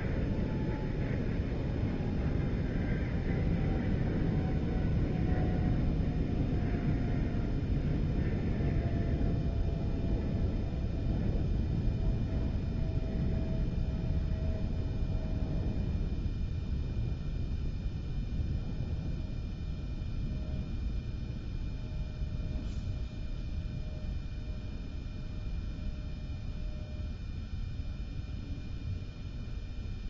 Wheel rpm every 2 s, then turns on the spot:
0, 0, 0, 0, 0, 0, 0, 0, 0, 0, 0, 0, 0, 0, 0.
none